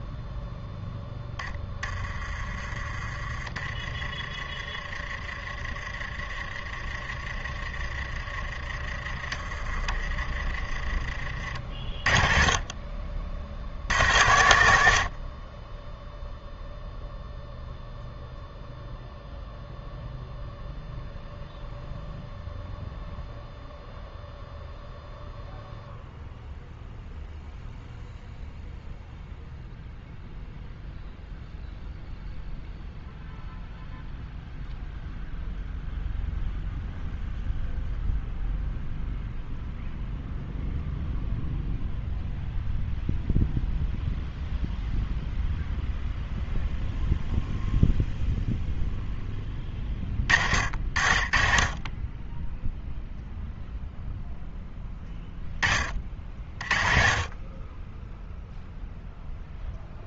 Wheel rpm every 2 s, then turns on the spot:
0, 30, 30, 30, 30, 40, 40, 80, 0, 0, 0, 0, 0, 0, 0, 0, 0, 0, 0, 0, 0, 0, 0, 0, 0, 50, 0, 10, 30, 0.
none